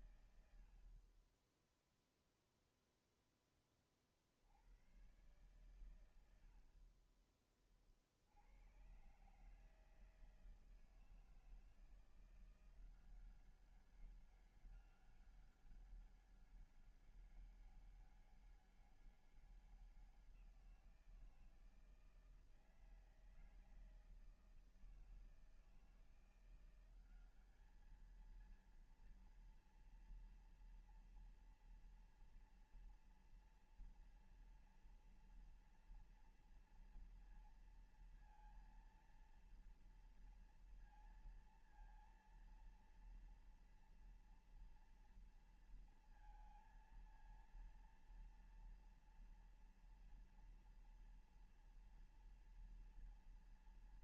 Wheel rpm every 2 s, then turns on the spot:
100, 0, 50, 100, 80, 160, 170, 190, 200, 200, 180, 160, 160, 170, 220, 230, 230, 230, 230, 230, 230, 230, 230, 230, 230, 240, 230.
none